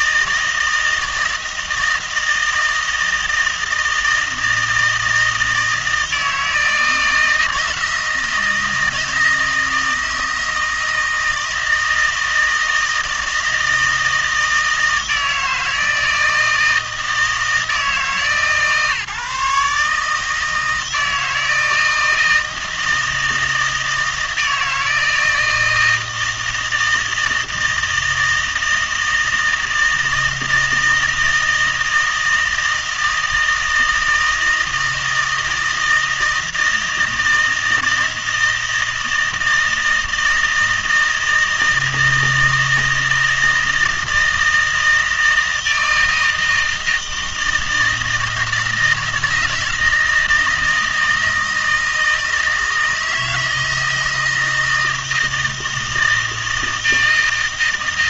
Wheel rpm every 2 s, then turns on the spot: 160, 160, 160, 160, 160, 160, 160, 160, 160, 150, 160, 160, 160, 160, 160, 160, 160, 160, 160, 160, 160, 160, 160, 160, 170, 160, 160, 160, 160.
none